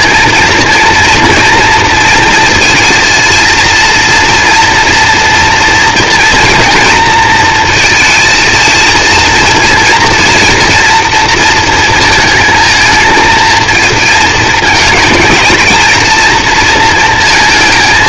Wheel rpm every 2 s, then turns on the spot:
230, 230, 230, 230, 230, 240, 230, 220, 230.
none